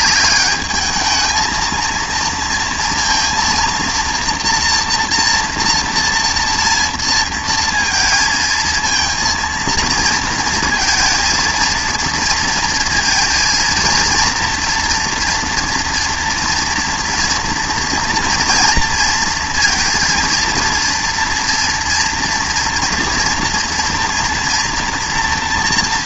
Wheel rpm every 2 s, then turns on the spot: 210, 230, 230, 230, 230, 230, 230, 230, 230, 230, 230, 240, 230.
none